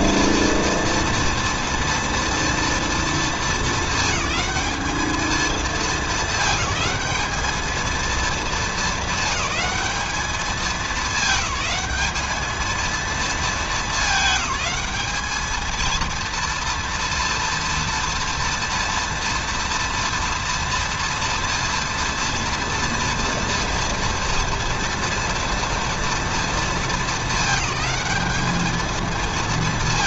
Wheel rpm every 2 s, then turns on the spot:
230, 230, 220, 200, 220, 210, 220, 210, 230, 230, 230, 240, 240, 230, 220.
none